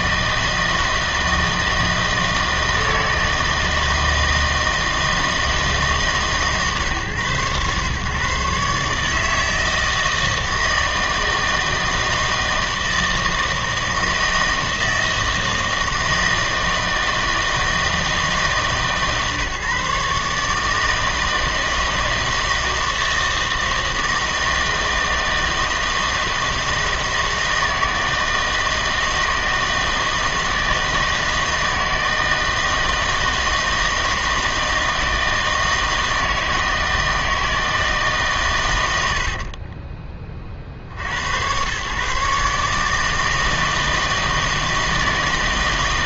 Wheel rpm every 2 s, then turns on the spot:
160, 160, 160, 140, 140, 160, 160, 160, 160, 150, 150, 160, 160, 160, 160, 160, 160, 160, 160, 120, 50, 150, 160.
none